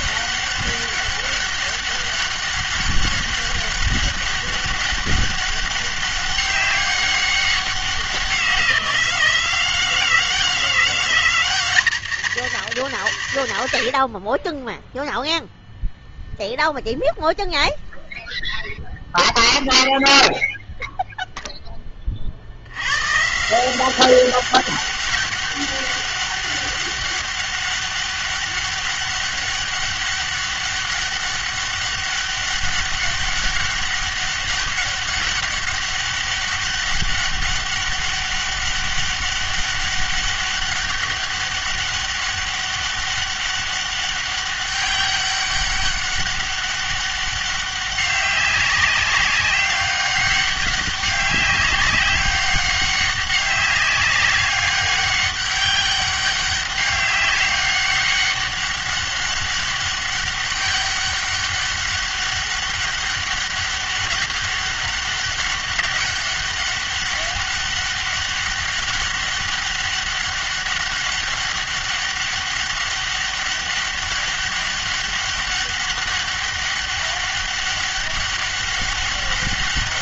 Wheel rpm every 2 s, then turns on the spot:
200, 200, 200, 200, 180, 190, 220, 10, 0, 0, 0, 90, 200, 200, 200, 200, 200, 200, 200, 200, 200, 200, 200, 200, 190, 200, 200, 200, 200, 200, 200, 200, 190, 200, 200, 200, 200, 200, 200, 200.
none